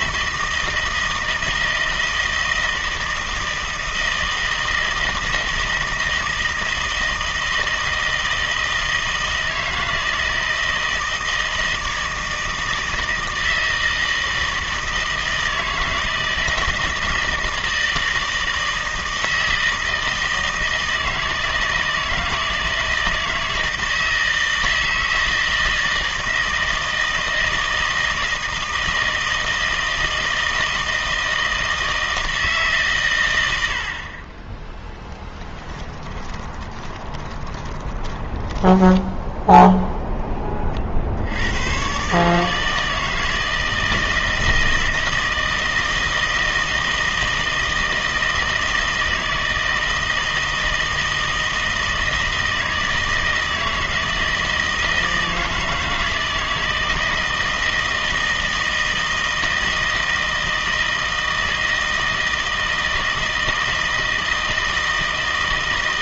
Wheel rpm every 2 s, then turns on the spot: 160, 160, 160, 160, 160, 160, 160, 160, 160, 160, 160, 160, 160, 160, 160, 160, 140, 10, 20, 20, 40, 160, 160, 160, 160, 160, 160, 160, 160, 160, 160, 160, 160.
36-40